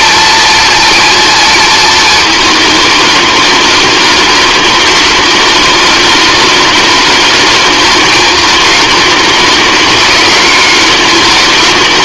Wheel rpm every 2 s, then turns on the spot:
230, 210, 210, 210, 210, 210.
none